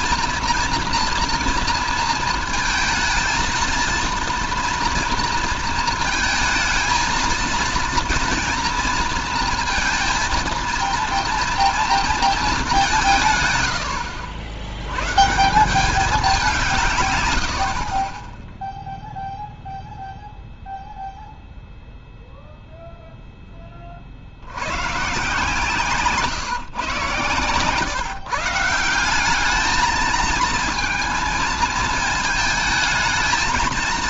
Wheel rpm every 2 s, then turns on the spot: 230, 220, 230, 230, 230, 230, 200, 90, 160, 0, 0, 0, 110, 140, 160, 230, 220.
none